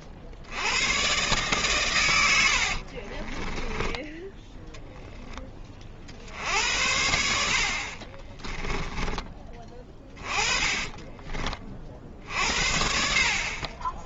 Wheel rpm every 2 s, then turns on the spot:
50, 70, 10, 70, 20, 20, 60.
2-4 8-12